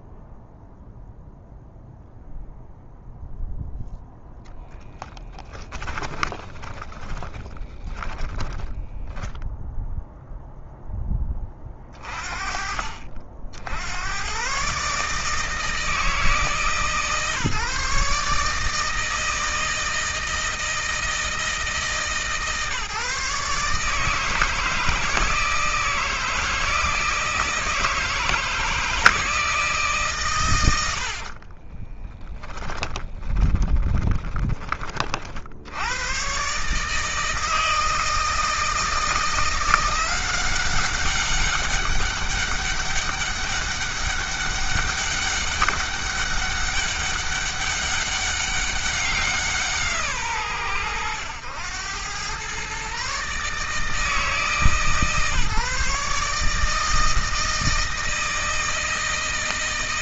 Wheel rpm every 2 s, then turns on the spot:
0, 0, 10, 20, 10, 10, 50, 140, 150, 160, 160, 150, 160, 160, 160, 100, 10, 30, 140, 160, 190, 200, 200, 200, 190, 100, 140, 150, 160, 160.
6-10 32-34